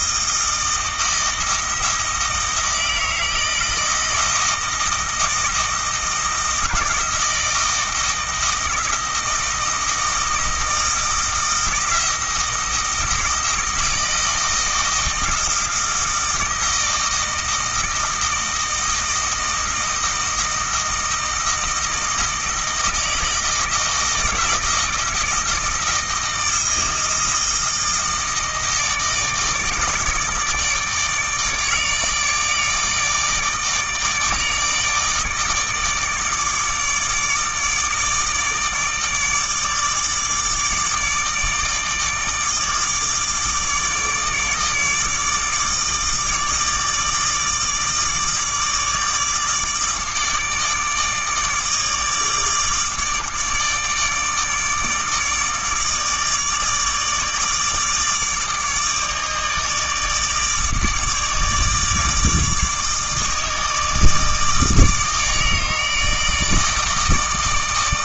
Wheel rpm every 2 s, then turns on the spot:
160, 160, 160, 160, 160, 160, 160, 160, 160, 160, 160, 160, 160, 160, 160, 160, 150, 150, 150, 160, 150, 150, 160, 150, 160, 150, 150, 150, 160, 160, 150, 150, 160, 160.
none